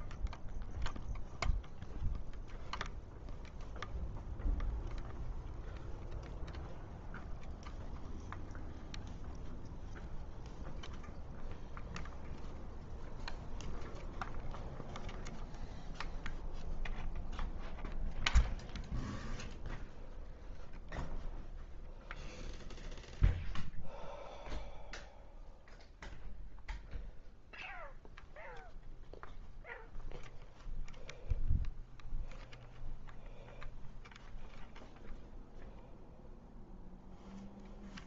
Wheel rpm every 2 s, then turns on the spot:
0, 0, 0, 0, 0, 0, 0, 0, 0, 0, 0, 0, 0, 0, 0, 0, 0, 0, 0.
none